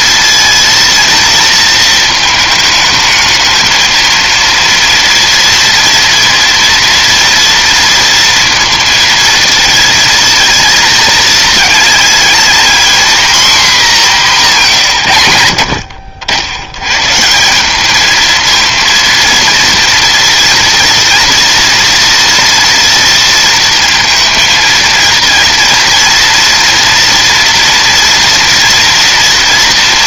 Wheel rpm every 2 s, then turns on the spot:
230, 220, 230, 230, 230, 230, 250, 150, 110, 230, 230, 230, 230, 240, 230.
none